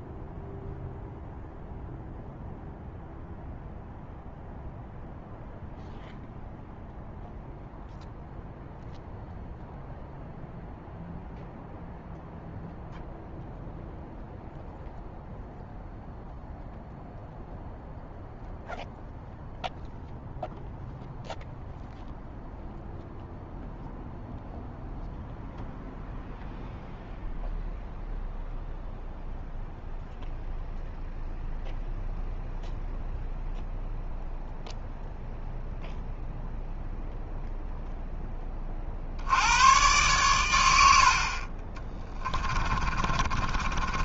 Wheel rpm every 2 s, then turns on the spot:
0, 0, 0, 0, 0, 0, 0, 0, 0, 0, 0, 0, 0, 0, 0, 0, 0, 0, 0, 40, 80, 40.
42-44